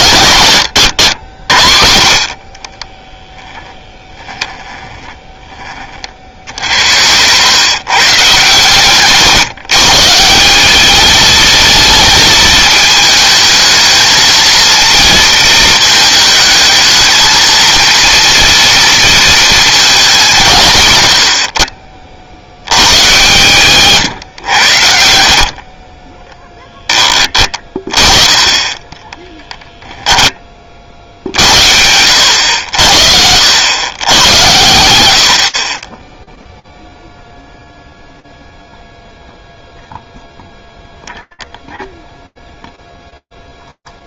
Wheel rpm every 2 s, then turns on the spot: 110, 30, 10, 60, 130, 190, 220, 230, 220, 230, 140, 90, 90, 0, 20, 30, 80, 110, 0, 0, 0, 0.
2-4